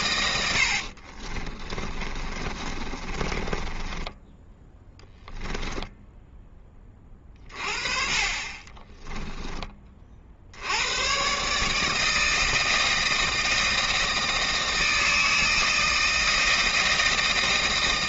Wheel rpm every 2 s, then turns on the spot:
60, 30, 10, 20, 20, 80, 160, 160, 160.
0-6 8-10